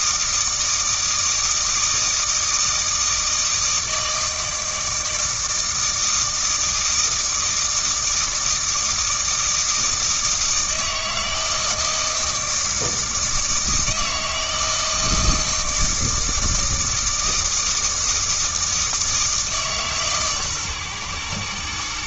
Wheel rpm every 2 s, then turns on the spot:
160, 160, 160, 160, 160, 160, 160, 160, 160, 160, 130.
none